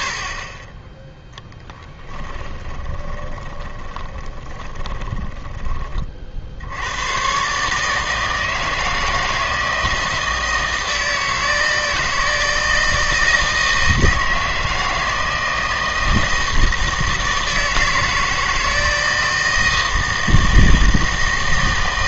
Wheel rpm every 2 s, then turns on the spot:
20, 20, 10, 80, 160, 160, 160, 160, 160, 160, 160.
2-6